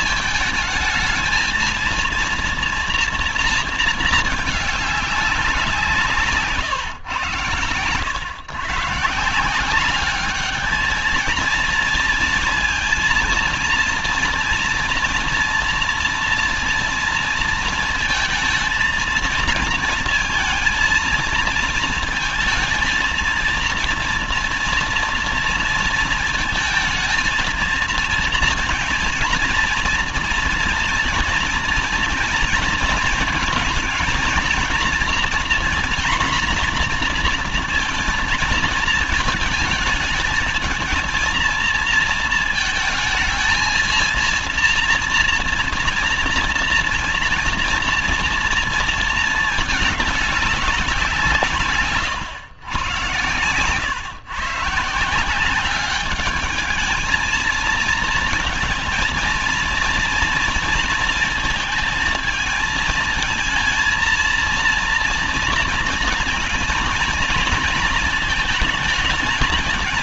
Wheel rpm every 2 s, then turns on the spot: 220, 230, 220, 150, 120, 210, 230, 240, 230, 220, 230, 230, 230, 220, 230, 230, 230, 230, 240, 230, 220, 230, 230, 230, 230, 200, 120, 140, 210, 220, 230, 220, 230, 230, 230.
none